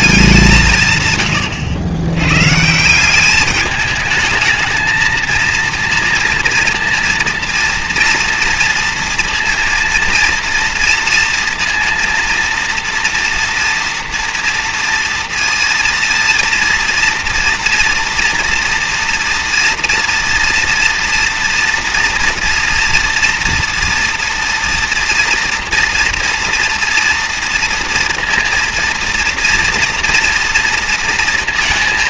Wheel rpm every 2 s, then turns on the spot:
120, 190, 230, 230, 230, 230, 230, 230, 230, 230, 230, 230, 230, 230, 240, 230.
none